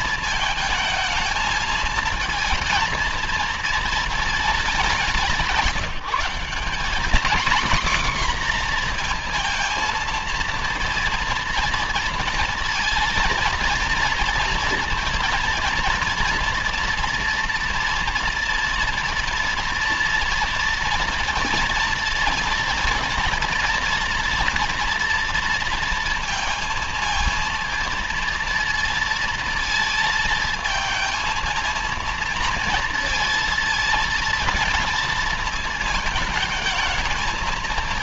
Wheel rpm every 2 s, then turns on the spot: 220, 230, 200, 230, 230, 230, 230, 230, 230, 230, 230, 230, 230, 230, 230, 230, 230, 220, 220.
none